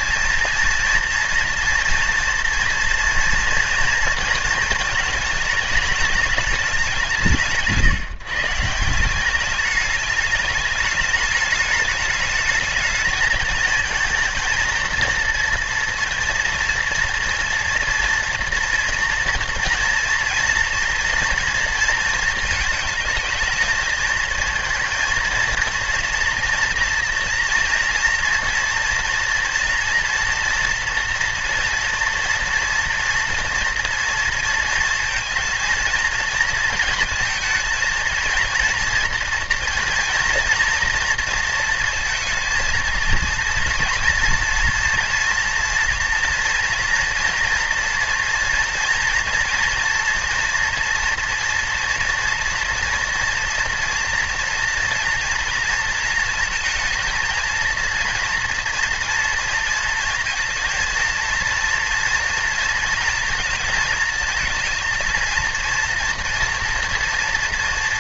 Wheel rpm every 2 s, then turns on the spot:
230, 230, 220, 190, 170, 210, 220, 230, 230, 230, 230, 220, 220, 230, 240, 230, 230, 230, 220, 230, 230, 230, 230, 230, 230, 240, 230, 230, 230, 230, 230, 230, 230, 230.
none